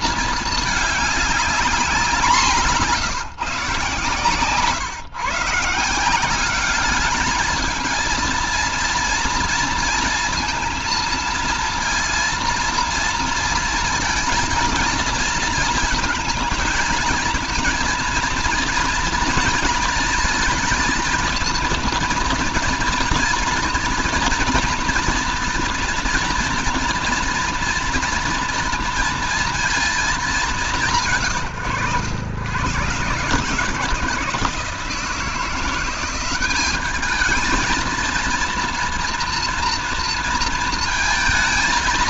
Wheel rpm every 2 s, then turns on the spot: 210, 170, 140, 200, 230, 230, 230, 230, 230, 230, 220, 230, 230, 230, 230, 160, 120, 170, 210, 240, 230.
none